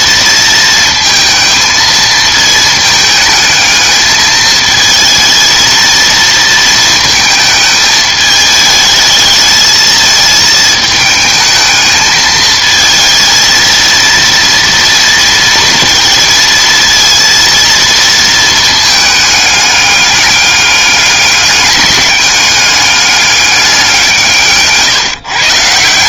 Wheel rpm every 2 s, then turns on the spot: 230, 220, 220, 230, 210, 220, 220, 230, 230, 220, 200, 200, 150.
none